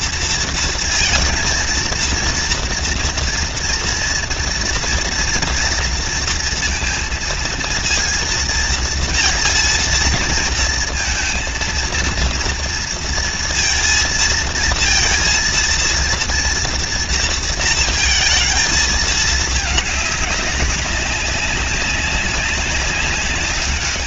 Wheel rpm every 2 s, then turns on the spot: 230, 230, 230, 230, 230, 230, 230, 230, 230, 220, 200, 200.
none